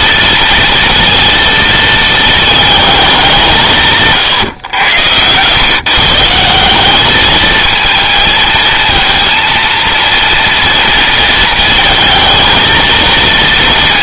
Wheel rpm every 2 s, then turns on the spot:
230, 210, 110, 200, 230, 230, 230.
none